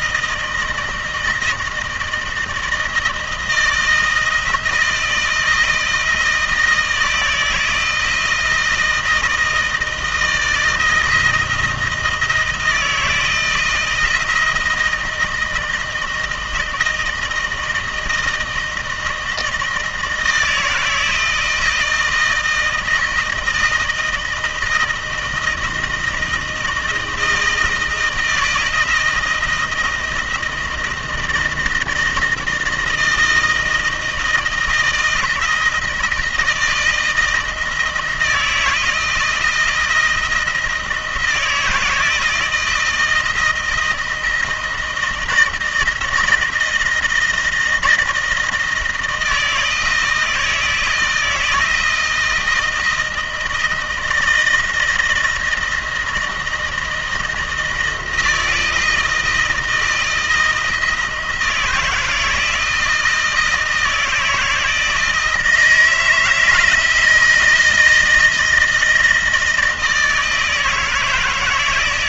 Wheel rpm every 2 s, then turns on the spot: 160, 160, 160, 160, 160, 170, 160, 170, 160, 160, 160, 160, 160, 160, 160, 170, 160, 160, 160, 160, 160, 160, 170, 160, 160, 160, 160, 160, 170, 160, 160, 160, 160, 160, 160, 160.
none